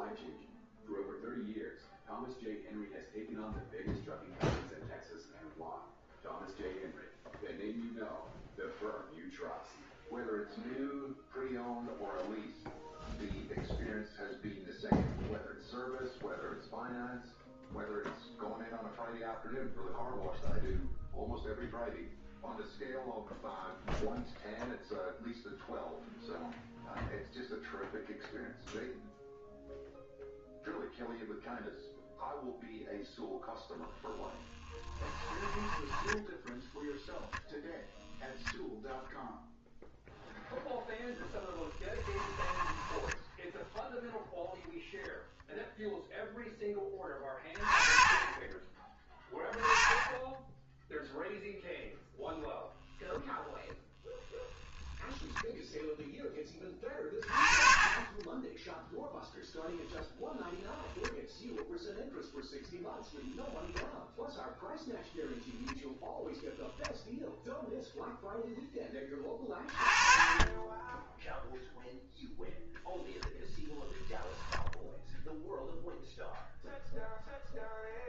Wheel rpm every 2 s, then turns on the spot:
0, 0, 0, 0, 0, 0, 0, 0, 0, 0, 0, 0, 0, 0, 0, 0, 0, 10, 0, 0, 0, 10, 0, 10, 20, 10, 0, 0, 20, 10, 0, 0, 0, 0, 10, 20, 0, 0, 0.
34-36 42-44